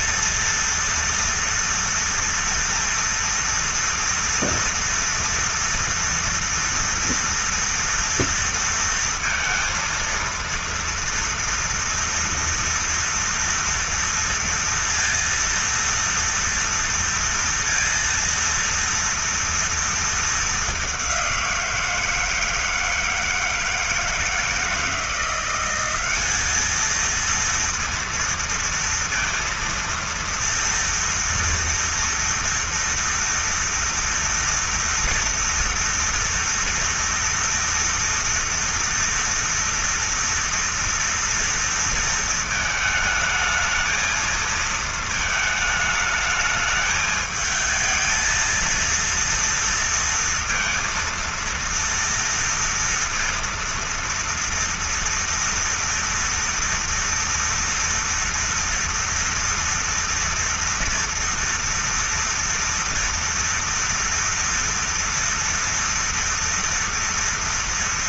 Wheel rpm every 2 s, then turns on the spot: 230, 230, 230, 230, 230, 230, 230, 230, 230, 230, 200, 160, 170, 220, 230, 230, 230, 230, 230, 230, 230, 220, 220, 220, 230, 230, 230, 230, 230, 230, 230, 230, 230, 230.
none